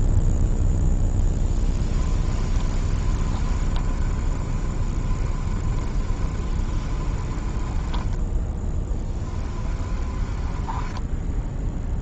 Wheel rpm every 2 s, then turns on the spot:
0, 30, 30, 30, 10, 10.
2-12